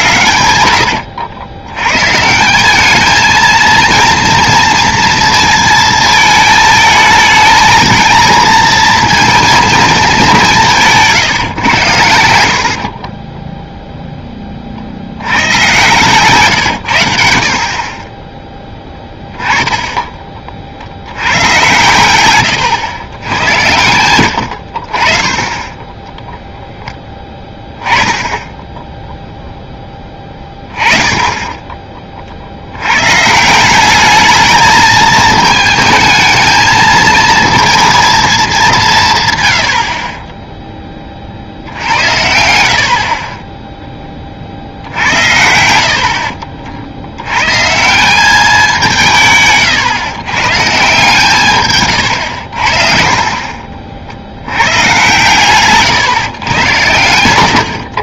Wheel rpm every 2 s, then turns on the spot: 90, 200, 230, 220, 230, 170, 60, 40, 110, 10, 40, 120, 70, 0, 10, 10, 80, 220, 220, 200, 10, 60, 60, 60, 180, 130, 60, 100, 100.
12-14 18-20